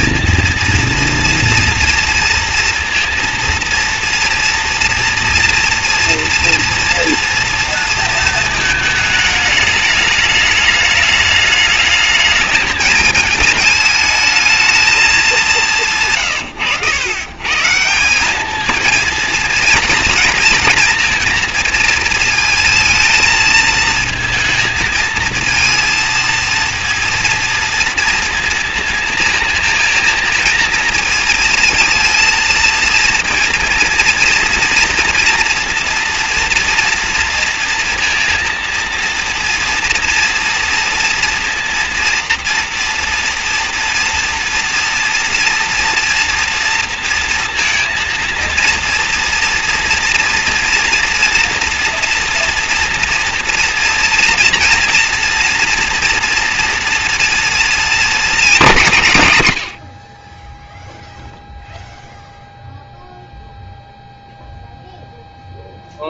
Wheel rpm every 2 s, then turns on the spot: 230, 230, 230, 230, 230, 220, 220, 220, 130, 210, 230, 230, 230, 230, 230, 220, 230, 230, 230, 230, 230, 230, 230, 230, 230, 230, 230, 230, 230, 230, 20, 0, 0.
16-18